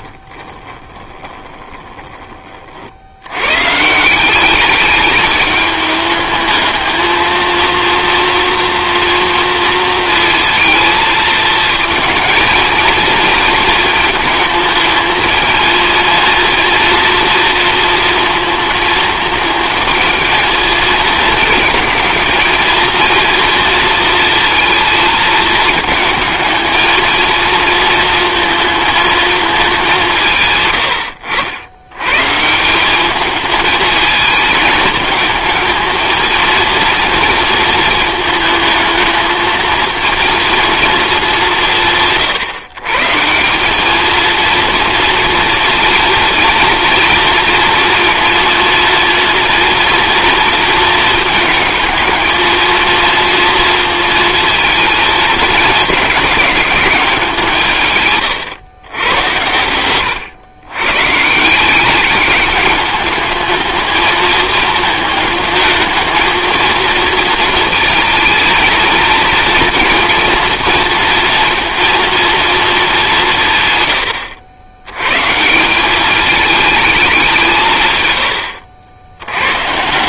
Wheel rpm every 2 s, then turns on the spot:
20, 70, 200, 220, 230, 230, 230, 220, 230, 220, 220, 230, 230, 220, 230, 100, 190, 220, 230, 220, 230, 140, 230, 230, 230, 220, 230, 220, 200, 120, 130, 210, 220, 230, 220, 230, 210, 100, 210, 80.
0-2